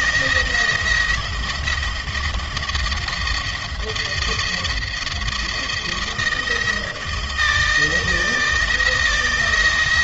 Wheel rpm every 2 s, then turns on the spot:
170, 170, 170, 160, 160.
none